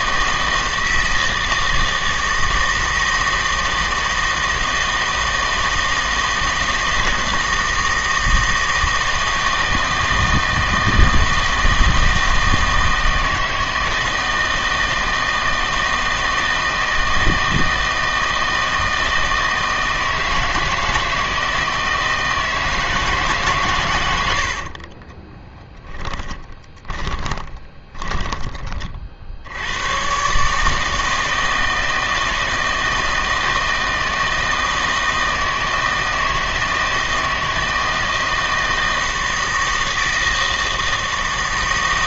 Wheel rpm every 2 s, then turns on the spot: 160, 160, 160, 160, 160, 160, 160, 160, 160, 160, 160, 160, 40, 20, 30, 150, 160, 160, 160, 160, 160.
24-28